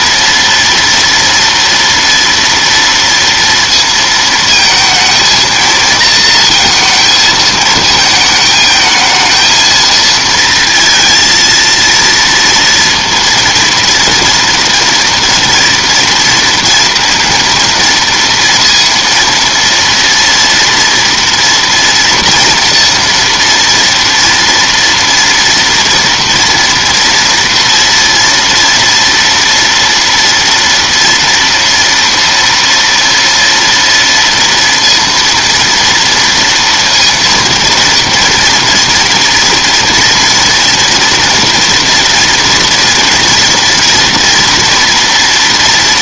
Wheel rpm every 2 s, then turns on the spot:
230, 230, 220, 230, 220, 230, 230, 230, 230, 230, 230, 230, 230, 230, 240, 230, 230, 230, 230, 230, 230, 230, 230.
none